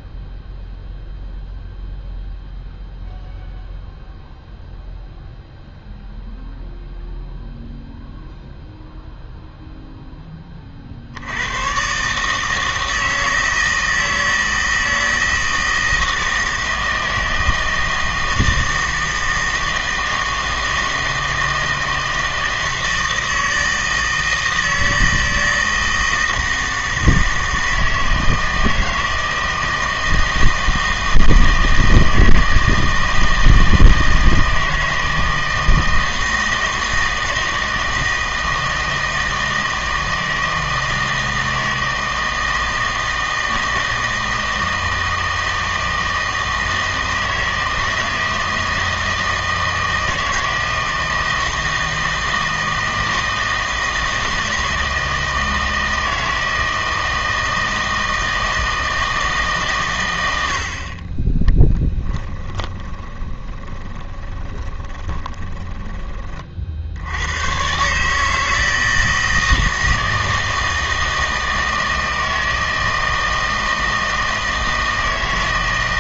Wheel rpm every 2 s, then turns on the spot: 0, 0, 0, 0, 0, 40, 160, 160, 160, 160, 160, 160, 160, 160, 160, 160, 160, 160, 160, 160, 160, 160, 160, 160, 160, 160, 160, 160, 160, 160, 60, 20, 20, 50, 160, 160, 160, 160.
62-66